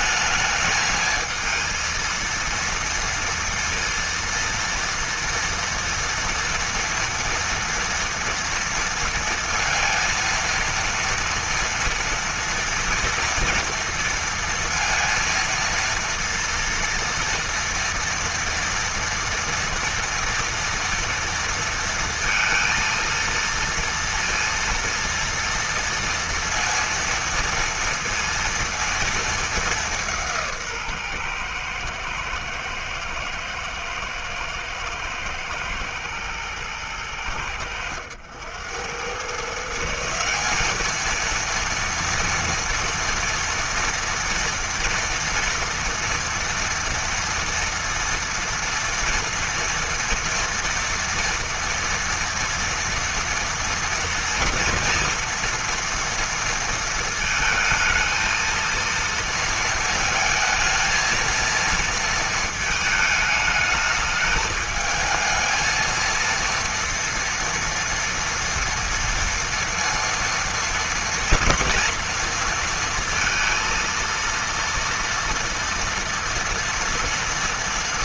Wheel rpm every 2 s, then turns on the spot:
220, 230, 230, 230, 230, 230, 230, 230, 230, 230, 240, 230, 230, 230, 230, 160, 110, 110, 110, 100, 200, 230, 230, 230, 230, 230, 230, 230, 230, 230, 230, 220, 220, 230, 230, 230, 230, 230, 230.
none